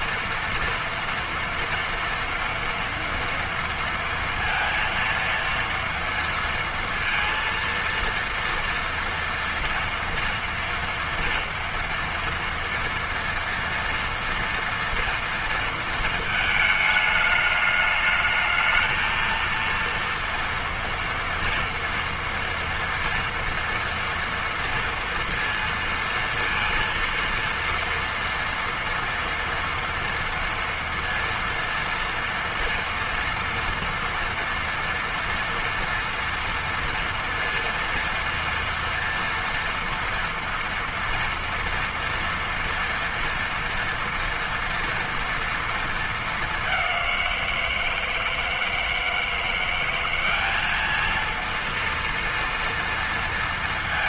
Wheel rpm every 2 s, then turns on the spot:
230, 230, 230, 230, 230, 230, 230, 230, 220, 220, 230, 230, 230, 230, 230, 230, 230, 230, 240, 230, 230, 230, 240, 200, 160, 210, 230.
none